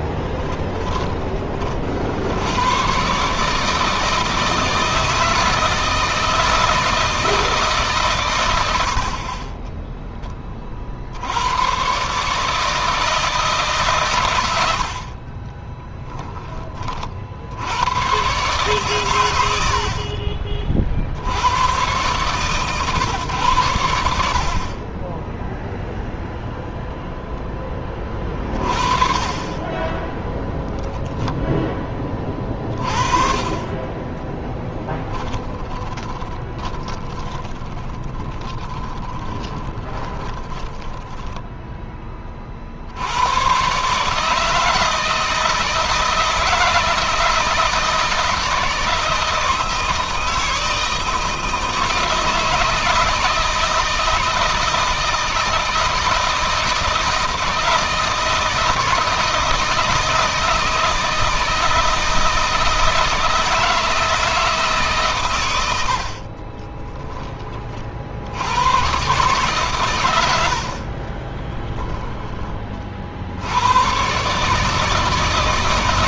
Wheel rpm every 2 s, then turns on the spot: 20, 120, 160, 160, 70, 50, 160, 60, 30, 120, 40, 130, 30, 0, 30, 0, 40, 10, 20, 20, 20, 70, 160, 160, 160, 160, 160, 160, 160, 160, 160, 160, 150, 20, 120, 50, 40, 160.
34-42 66-68 70-72